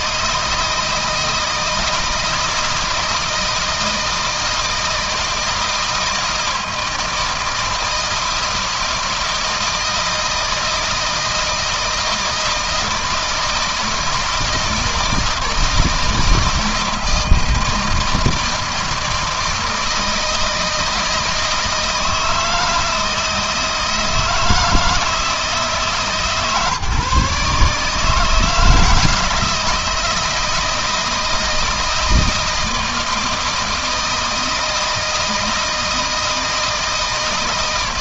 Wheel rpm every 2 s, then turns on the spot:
160, 160, 160, 160, 160, 160, 160, 160, 160, 160, 160, 160, 170, 150, 160, 170, 160, 160, 160.
none